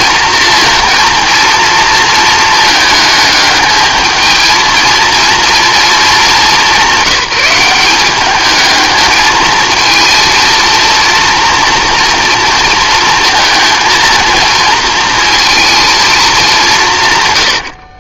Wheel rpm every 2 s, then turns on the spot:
230, 220, 220, 200, 220, 230, 230, 220, 180.
none